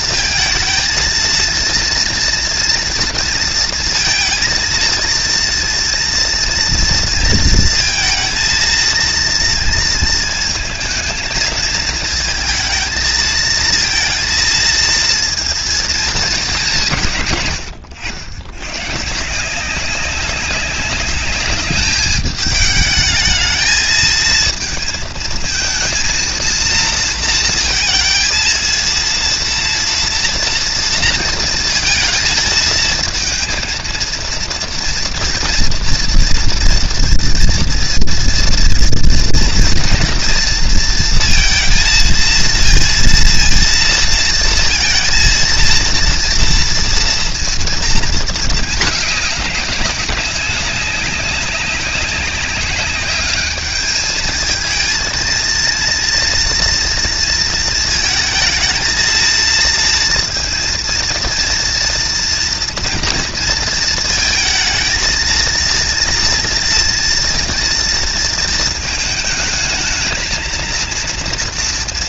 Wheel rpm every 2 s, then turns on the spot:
230, 230, 230, 230, 230, 220, 220, 230, 170, 130, 200, 210, 220, 230, 230, 230, 230, 230, 230, 230, 230, 230, 230, 230, 210, 200, 200, 220, 230, 230, 230, 230, 230, 240, 220, 230.
none